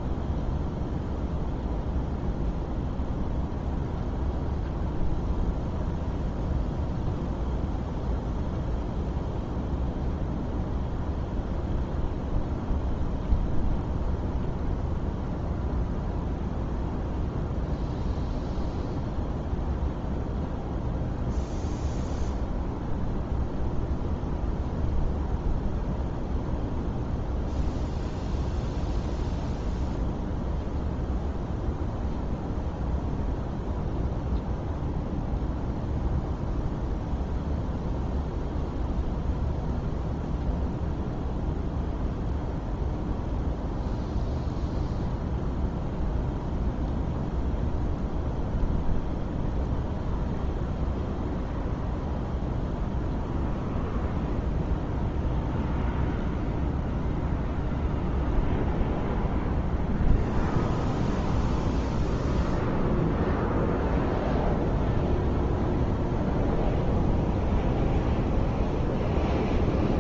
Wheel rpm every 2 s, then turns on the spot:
0, 0, 0, 0, 0, 0, 0, 0, 0, 0, 0, 0, 0, 0, 0, 0, 0, 0, 0, 0, 0, 0, 0, 0, 0, 0, 0, 0, 0, 0, 0, 0, 0, 0, 0.
none